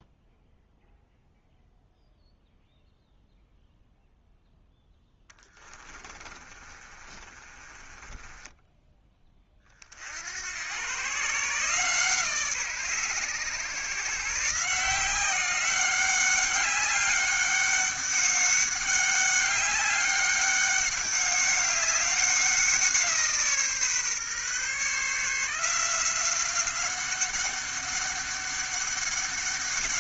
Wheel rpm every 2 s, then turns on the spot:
0, 0, 0, 30, 10, 120, 140, 170, 200, 200, 200, 170, 140, 190, 200.
6-8